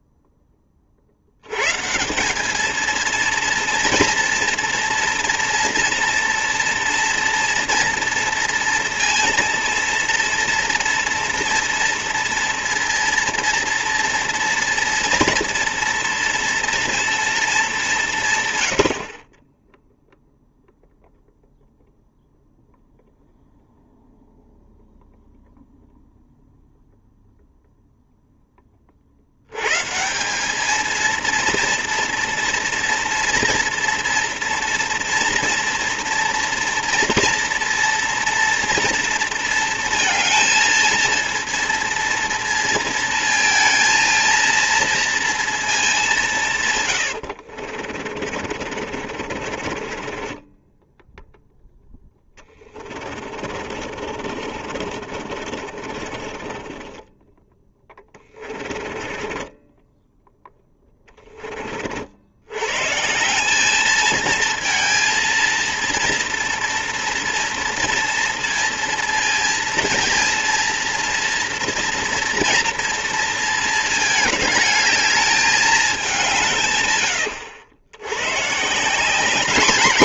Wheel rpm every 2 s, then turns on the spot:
20, 210, 240, 240, 230, 230, 230, 230, 230, 100, 0, 0, 0, 0, 20, 210, 230, 230, 230, 230, 230, 230, 230, 130, 50, 10, 20, 50, 20, 20, 10, 120, 230, 230, 230, 230, 230, 210, 140, 150.
48-62